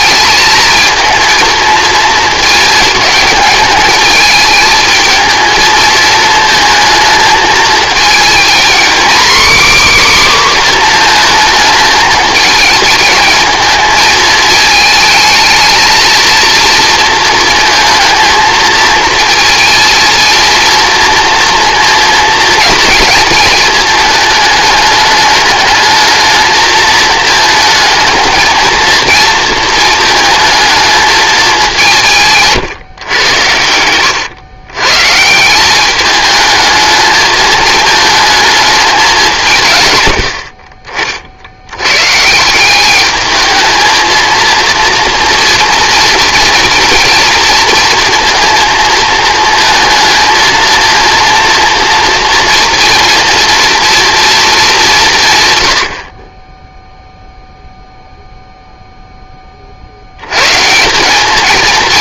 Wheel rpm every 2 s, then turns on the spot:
220, 220, 220, 220, 250, 240, 220, 220, 230, 230, 230, 230, 210, 220, 230, 220, 130, 130, 220, 210, 40, 190, 230, 230, 230, 230, 230, 190, 0, 0, 180.
none